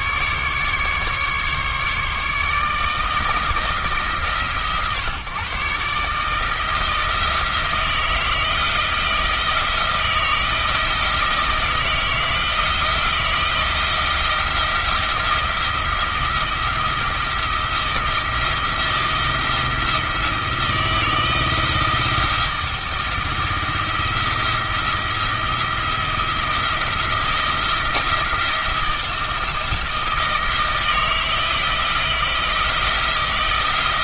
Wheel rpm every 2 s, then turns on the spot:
140, 160, 130, 160, 160, 160, 170, 170, 170, 160, 160, 170, 170, 170, 170, 160, 170.
none